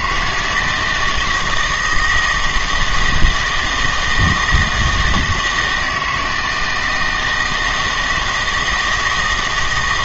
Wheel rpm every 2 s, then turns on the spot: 160, 160, 160, 160, 160.
none